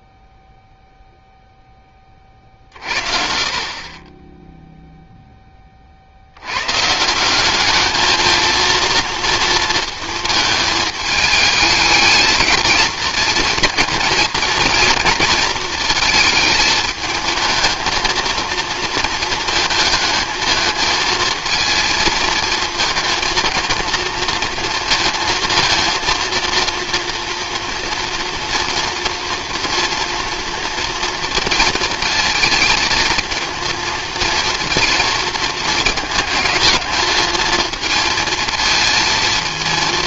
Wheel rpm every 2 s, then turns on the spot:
0, 50, 0, 120, 230, 220, 220, 230, 220, 230, 220, 230, 230, 230, 240, 230, 230, 230, 220, 220.
none